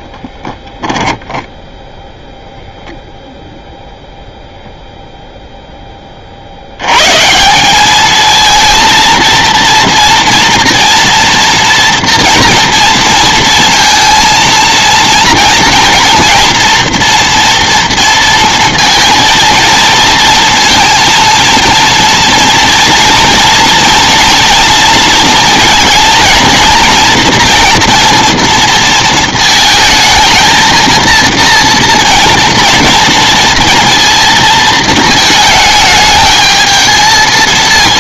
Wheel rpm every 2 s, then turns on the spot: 10, 0, 0, 160, 230, 230, 230, 230, 240, 230, 230, 230, 230, 230, 220, 230, 230, 220, 230.
none